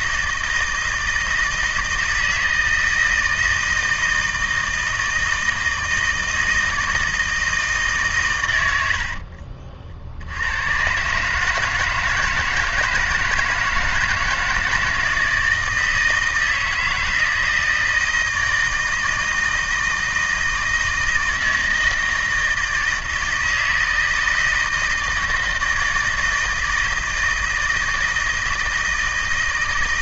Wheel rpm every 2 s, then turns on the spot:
160, 160, 160, 160, 70, 130, 160, 160, 160, 160, 160, 160, 160, 160, 160.
none